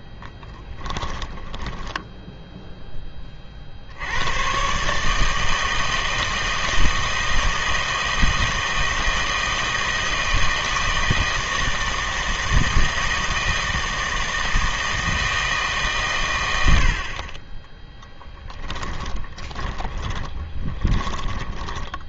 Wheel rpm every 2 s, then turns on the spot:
10, 0, 130, 160, 160, 160, 160, 160, 70, 20, 20.
0-2 18-22